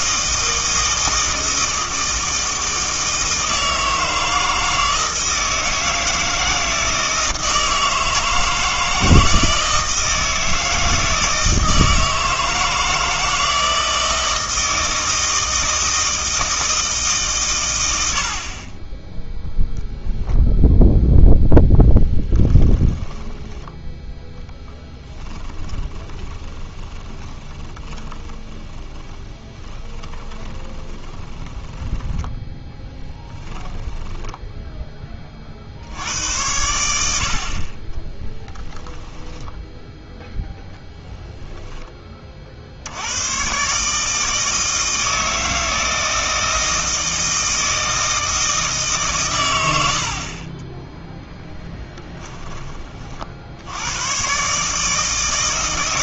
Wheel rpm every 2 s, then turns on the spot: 160, 160, 160, 160, 160, 160, 160, 160, 160, 30, 0, 10, 10, 20, 20, 20, 10, 10, 80, 10, 10, 50, 160, 160, 160, 20, 20, 140.
22-24 26-34